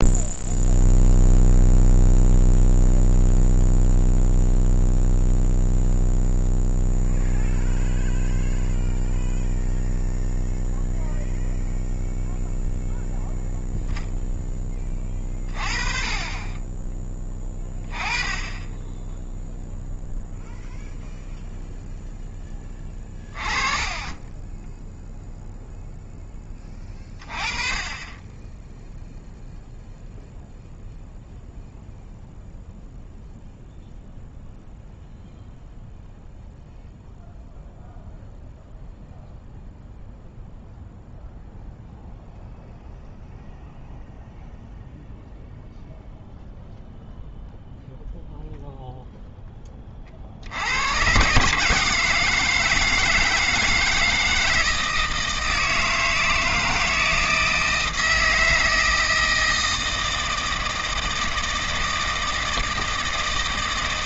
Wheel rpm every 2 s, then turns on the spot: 0, 0, 0, 0, 0, 0, 0, 10, 20, 20, 0, 10, 10, 20, 10, 0, 0, 0, 0, 0, 0, 0, 0, 0, 0, 80, 160, 160, 160, 160, 160, 160.
none